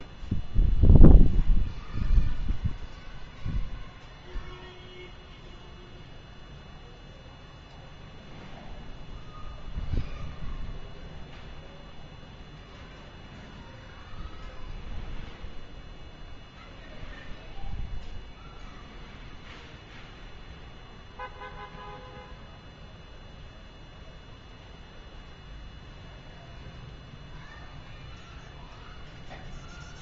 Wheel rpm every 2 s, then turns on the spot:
0, 0, 0, 0, 0, 0, 0, 0, 0, 0, 0, 0, 0, 0, 0.
none